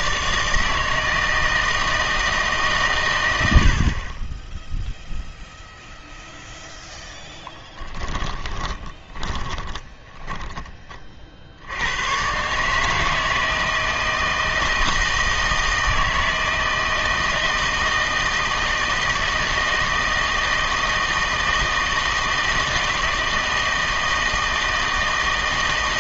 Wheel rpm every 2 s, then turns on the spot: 160, 140, 0, 0, 10, 40, 150, 160, 160, 160, 160, 160, 160.
8-12